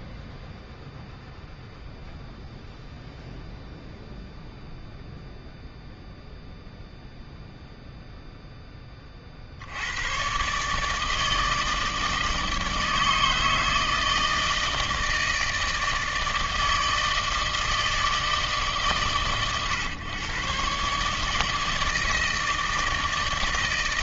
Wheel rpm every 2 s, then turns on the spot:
0, 0, 0, 0, 0, 130, 160, 160, 160, 140, 130, 160.
none